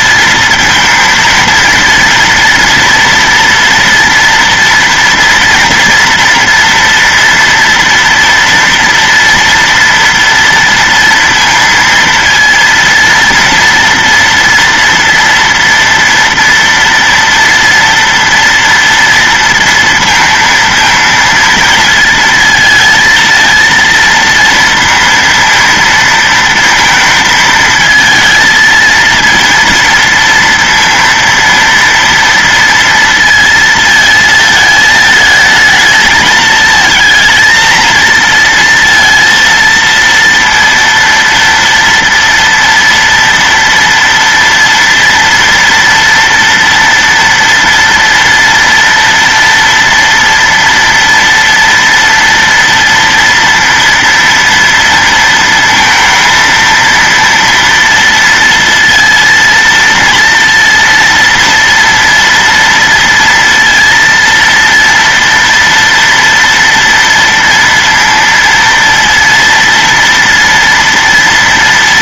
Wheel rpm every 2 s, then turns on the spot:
220, 230, 230, 230, 230, 240, 230, 230, 230, 230, 230, 230, 230, 230, 220, 230, 230, 220, 220, 230, 230, 230, 230, 230, 230, 230, 230, 230, 230, 230, 230, 230, 230, 230, 230, 230.
none